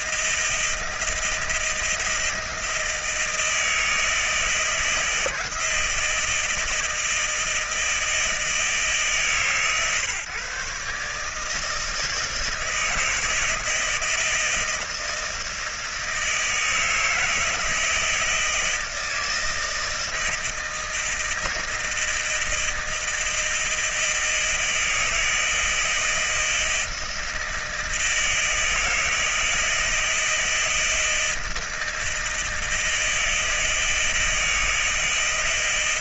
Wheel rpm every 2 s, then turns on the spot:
170, 160, 160, 160, 160, 140, 160, 160, 160, 160, 160, 160, 160, 160, 160, 160, 160, 160.
none